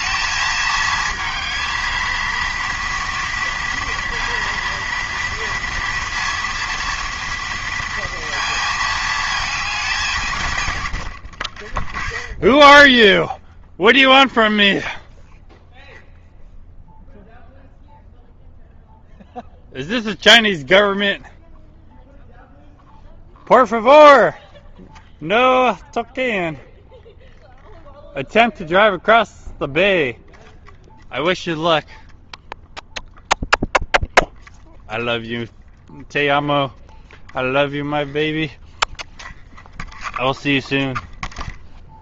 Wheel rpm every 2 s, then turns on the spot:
220, 230, 230, 230, 220, 110, 20, 0, 0, 0, 0, 0, 0, 0, 0, 0, 0, 0, 0, 0, 0.
12-14